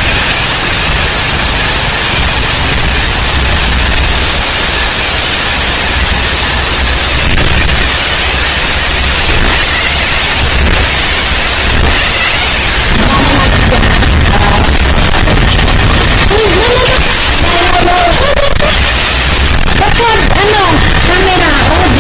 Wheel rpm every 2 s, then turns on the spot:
200, 220, 220, 210, 130, 120, 90, 0, 10, 40, 10.
10-12 16-18